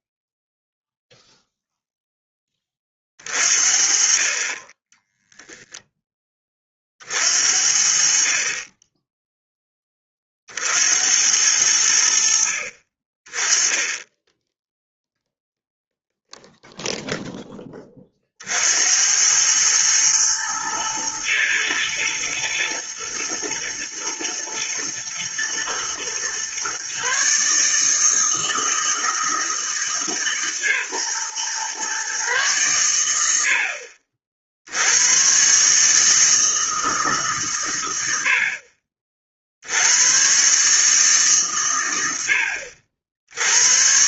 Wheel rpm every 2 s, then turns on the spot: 0, 20, 30, 30, 30, 50, 50, 10, 0, 60, 110, 110, 110, 130, 160, 140, 120, 70, 160, 60, 140, 70.
none